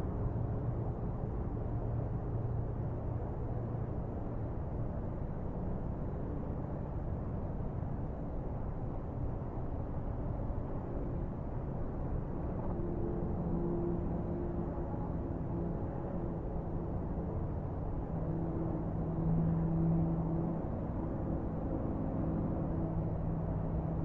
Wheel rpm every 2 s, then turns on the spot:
0, 0, 0, 0, 0, 0, 0, 0, 0, 0, 0, 0.
none